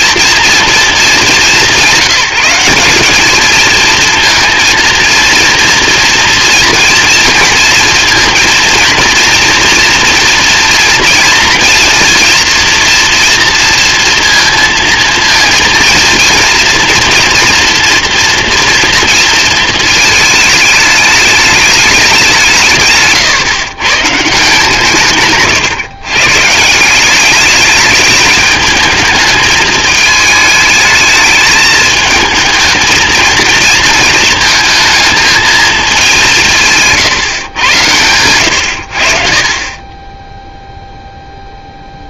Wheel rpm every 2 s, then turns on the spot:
230, 200, 230, 240, 230, 240, 240, 230, 240, 240, 220, 160, 160, 160, 220, 220, 220, 230, 160, 90, 0.
none